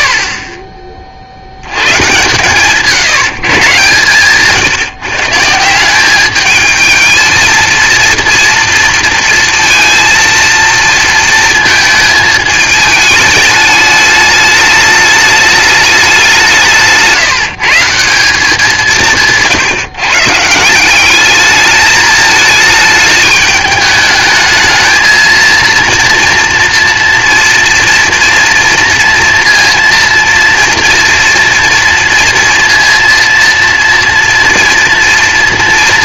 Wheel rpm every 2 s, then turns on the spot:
40, 140, 140, 210, 230, 230, 210, 210, 170, 180, 170, 220, 220, 230, 230, 230, 230, 240.
none